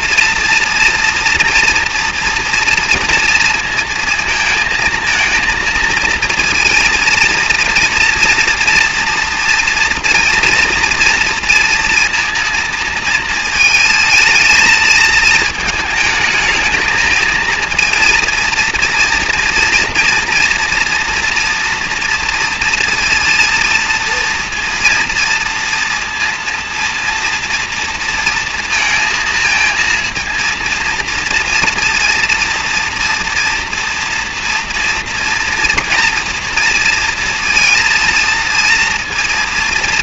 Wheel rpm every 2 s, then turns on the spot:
240, 230, 230, 230, 230, 230, 230, 220, 220, 230, 230, 230, 240, 230, 230, 230, 230, 230, 230, 230.
none